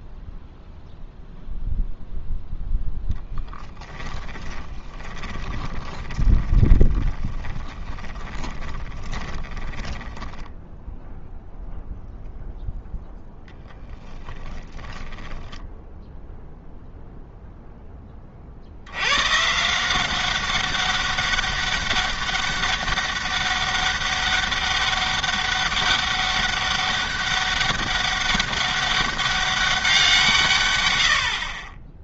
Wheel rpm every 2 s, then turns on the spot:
0, 0, 20, 20, 20, 10, 0, 10, 0, 70, 200, 200, 200, 200, 200, 110.
4-10 14-16